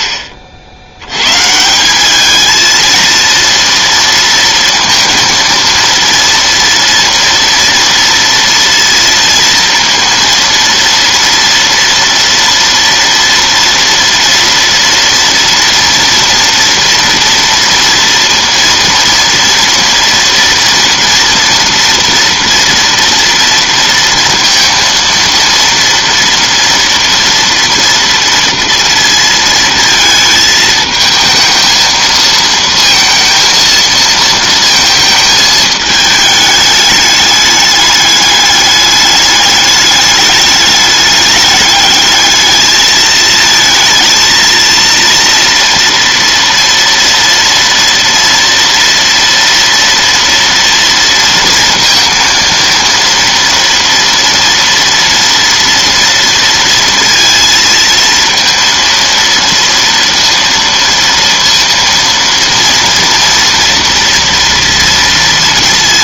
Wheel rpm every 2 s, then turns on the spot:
60, 220, 230, 230, 230, 230, 230, 230, 240, 230, 240, 230, 230, 230, 230, 220, 230, 220, 210, 210, 210, 220, 230, 230, 230, 230, 230, 230, 230, 230, 230, 230, 230.
none